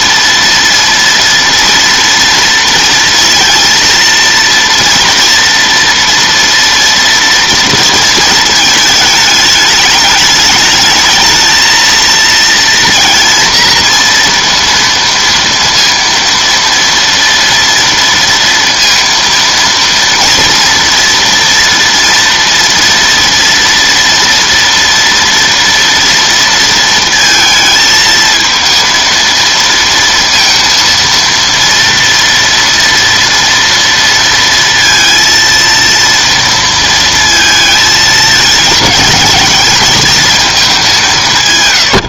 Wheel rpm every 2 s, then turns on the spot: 230, 230, 230, 230, 220, 220, 230, 230, 230, 230, 230, 230, 230, 230, 220, 230, 230, 230, 230, 210, 210.
none